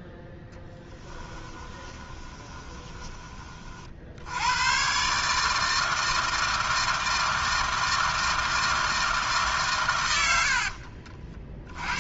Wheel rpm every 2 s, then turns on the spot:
10, 20, 110, 160, 160, 60.
0-4 10-12